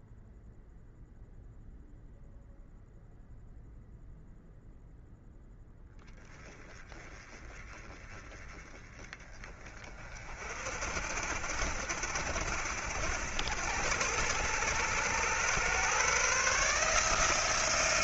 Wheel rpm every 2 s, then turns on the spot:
0, 0, 0, 20, 20, 50, 70, 90, 150.
none